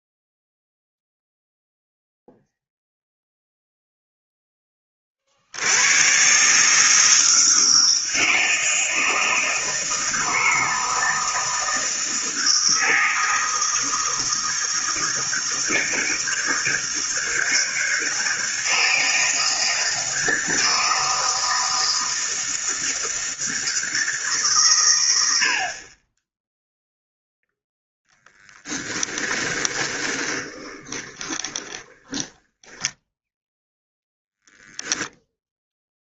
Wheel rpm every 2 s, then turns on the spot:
0, 0, 20, 150, 160, 160, 160, 160, 160, 160, 160, 160, 130, 0, 10, 20, 10, 0.
28-34